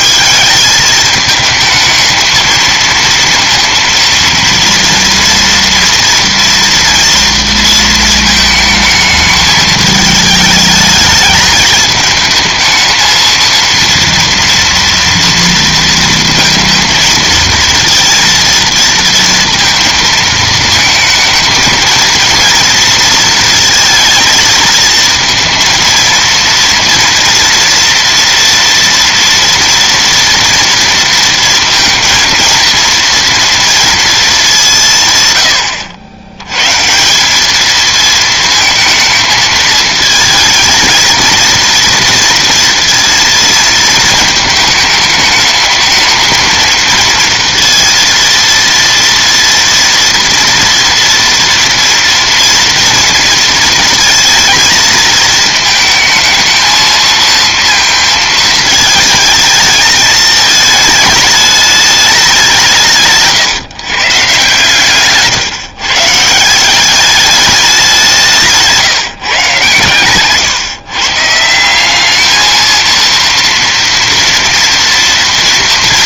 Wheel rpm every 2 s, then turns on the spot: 190, 220, 230, 230, 220, 210, 220, 230, 230, 230, 220, 230, 220, 230, 230, 230, 230, 210, 100, 220, 230, 230, 220, 220, 230, 230, 230, 230, 220, 220, 220, 190, 130, 160, 170, 140, 220, 230.
none